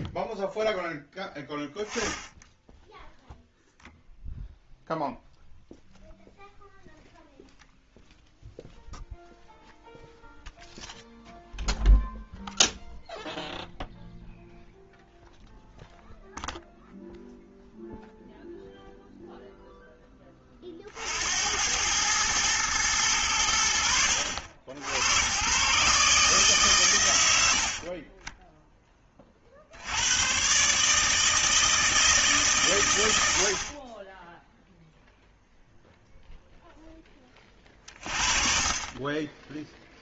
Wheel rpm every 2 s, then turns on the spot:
10, 10, 0, 0, 0, 0, 0, 0, 0, 0, 40, 110, 70, 130, 10, 140, 130, 0, 0, 30.
none